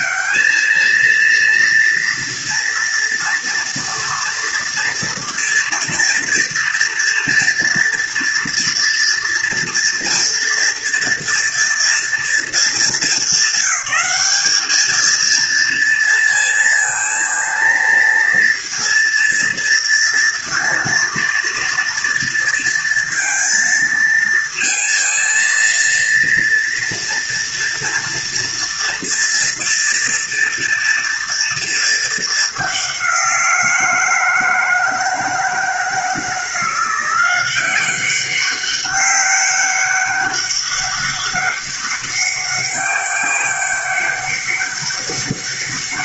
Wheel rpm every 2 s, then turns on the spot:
220, 230, 230, 230, 230, 230, 220, 200, 230, 230, 230, 230, 230, 230, 230, 230, 200, 160, 170, 190, 200, 200, 200.
none